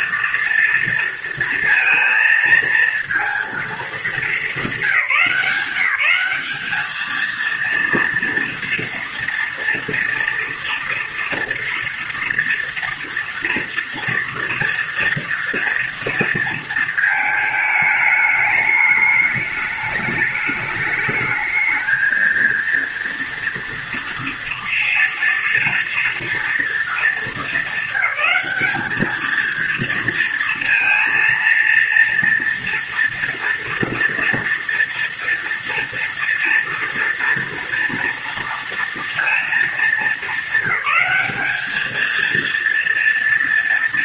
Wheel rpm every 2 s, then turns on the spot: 230, 230, 210, 210, 230, 240, 230, 230, 230, 220, 210, 230, 230, 230, 220, 230, 230, 230, 230, 230, 210, 230.
none